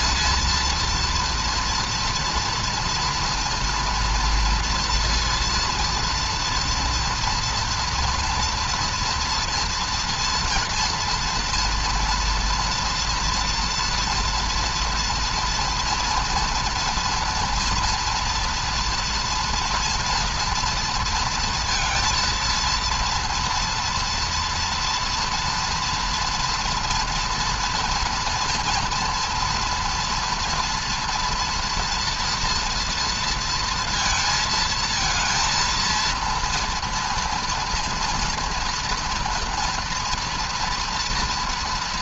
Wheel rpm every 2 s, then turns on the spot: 230, 230, 240, 230, 240, 230, 240, 240, 240, 240, 230, 230, 230, 230, 230, 230, 230, 230, 230, 230, 230.
none